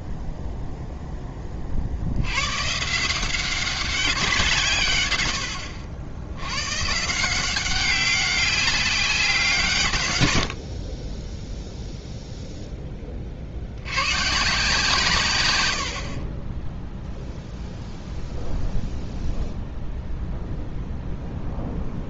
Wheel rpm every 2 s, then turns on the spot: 0, 120, 170, 70, 190, 70, 0, 140, 10, 0, 0.
none